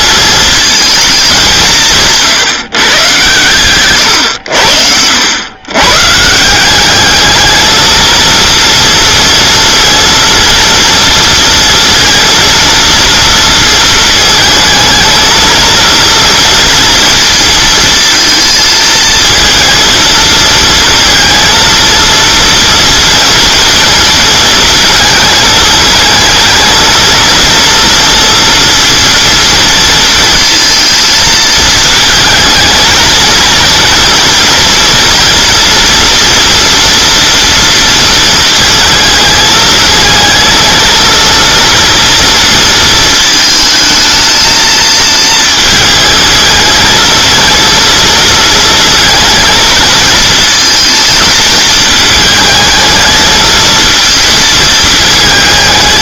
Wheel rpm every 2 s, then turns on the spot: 220, 120, 80, 190, 230, 230, 230, 220, 230, 230, 230, 230, 230, 230, 230, 230, 220, 230, 240, 230, 230, 230, 220, 220, 230, 230, 220, 220.
none